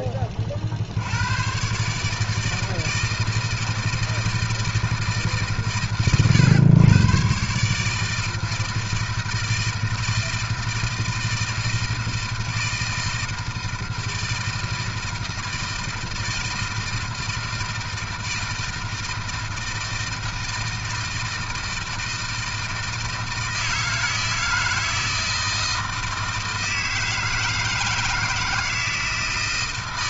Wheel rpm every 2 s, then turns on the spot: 40, 160, 160, 100, 160, 160, 160, 160, 160, 160, 160, 160, 160, 160, 160.
none